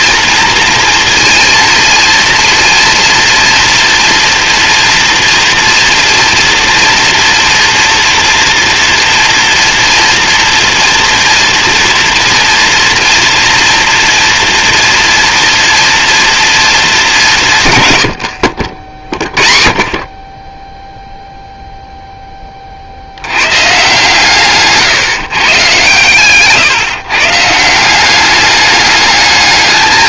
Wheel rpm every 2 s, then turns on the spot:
230, 230, 230, 240, 240, 230, 230, 230, 200, 50, 0, 70, 140, 140, 210.
none